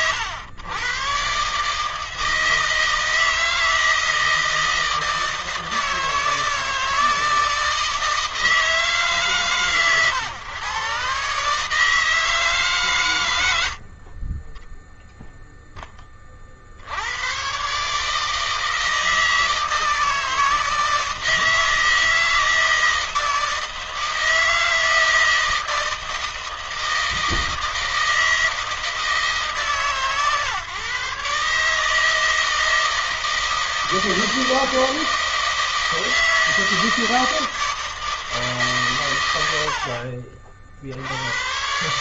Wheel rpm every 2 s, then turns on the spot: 120, 160, 160, 160, 160, 110, 150, 20, 50, 160, 160, 160, 160, 160, 160, 150, 160, 160, 160, 140, 50.
none